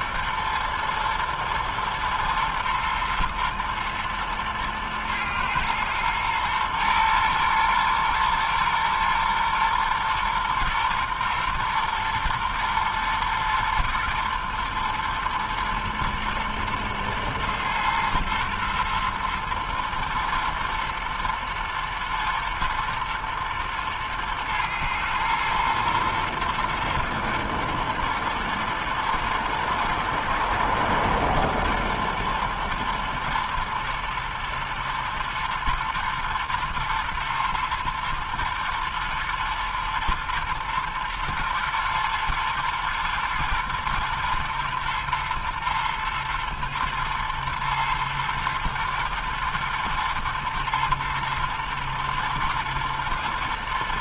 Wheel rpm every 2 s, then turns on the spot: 120, 120, 110, 110, 120, 120, 120, 110, 110, 110, 110, 110, 110, 120, 110, 110, 120, 110, 110, 120, 110, 110, 110, 110, 110, 110, 110.
none